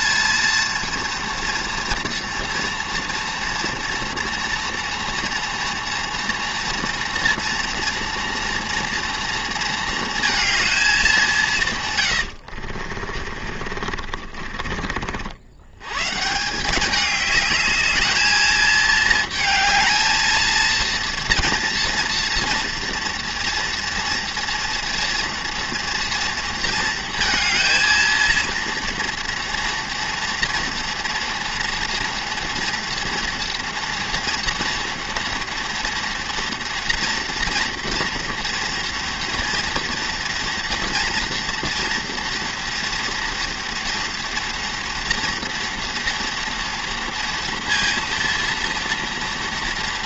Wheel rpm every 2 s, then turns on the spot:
240, 230, 230, 240, 230, 210, 50, 60, 200, 220, 230, 230, 230, 230, 230, 240, 240, 230, 240, 230, 230, 230, 240, 230, 230.
12-14